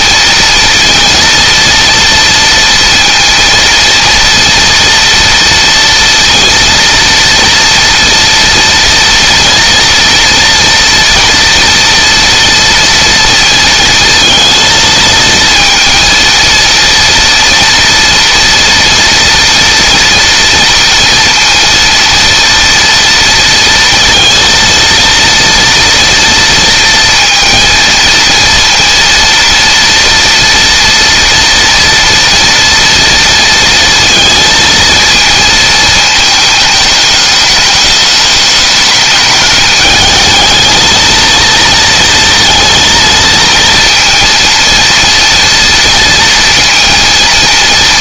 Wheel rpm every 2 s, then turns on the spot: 230, 230, 230, 230, 230, 230, 230, 230, 230, 230, 230, 230, 230, 230, 230, 230, 230, 230, 210, 210, 230, 230, 230, 230.
none